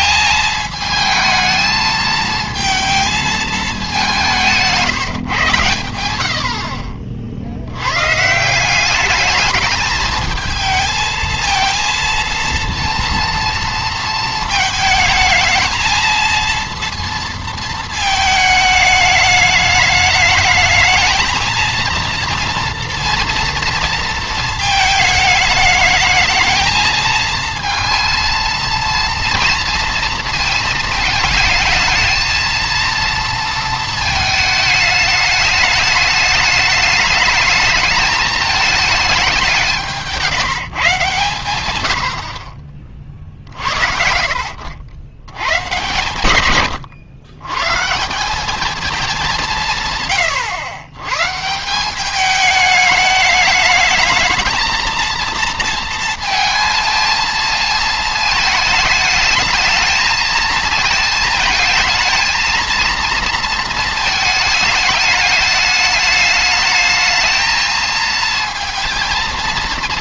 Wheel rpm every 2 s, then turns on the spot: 220, 220, 170, 60, 180, 220, 230, 220, 230, 210, 220, 230, 220, 220, 230, 220, 230, 220, 210, 210, 160, 60, 70, 110, 210, 100, 210, 220, 230, 220, 220, 230, 210, 210, 230.
none